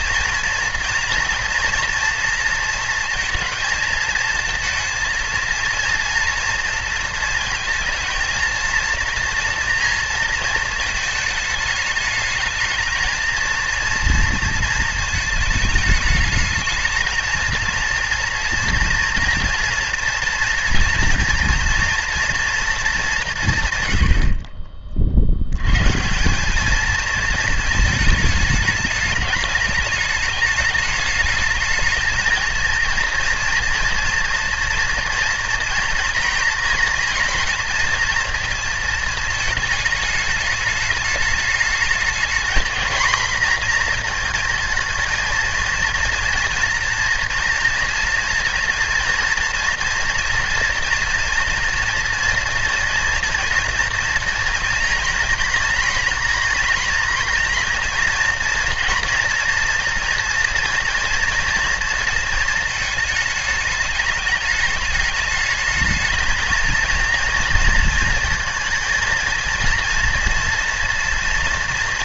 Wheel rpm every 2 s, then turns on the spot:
240, 230, 230, 230, 230, 220, 220, 230, 220, 230, 230, 220, 40, 210, 210, 210, 230, 230, 230, 230, 210, 230, 230, 230, 230, 230, 230, 240, 230, 230, 230, 220, 210, 220, 220, 240.
none